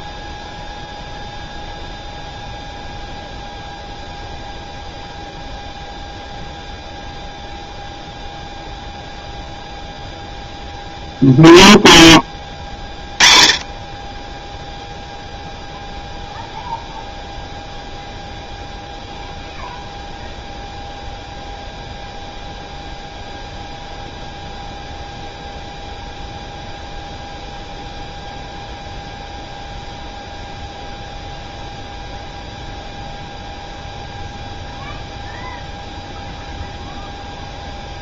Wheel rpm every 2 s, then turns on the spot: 0, 0, 0, 0, 0, 0, 20, 0, 0, 0, 0, 0, 0, 0, 0, 0, 0, 0, 0.
none